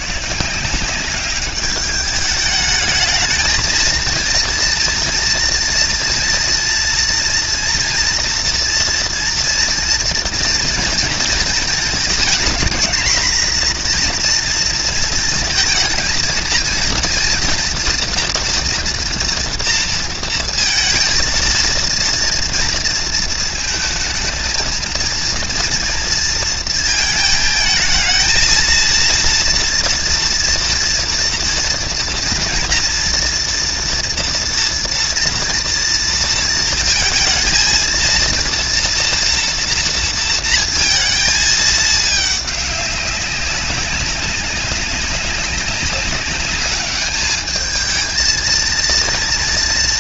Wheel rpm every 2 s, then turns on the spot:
170, 210, 230, 230, 230, 230, 230, 230, 230, 240, 230, 230, 230, 230, 230, 240, 230, 230, 230, 230, 230, 200, 190, 210, 230.
none